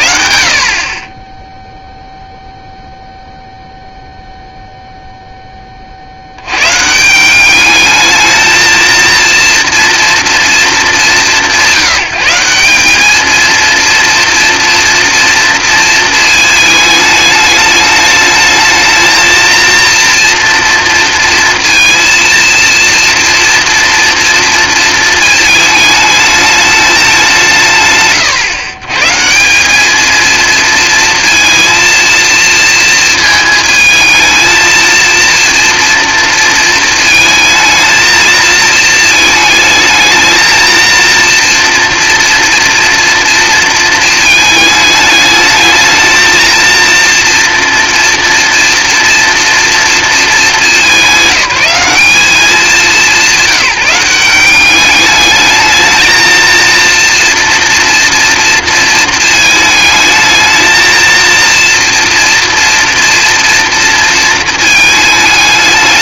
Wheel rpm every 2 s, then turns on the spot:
50, 0, 0, 130, 220, 210, 190, 230, 220, 220, 230, 230, 230, 210, 130, 230, 230, 230, 230, 220, 230, 240, 220, 230, 230, 190, 180, 190, 230, 230, 220, 240, 220.
none